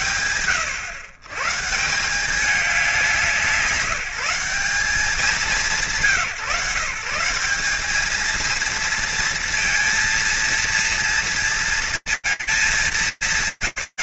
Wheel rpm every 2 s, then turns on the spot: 130, 180, 160, 180, 230, 230, 220.
none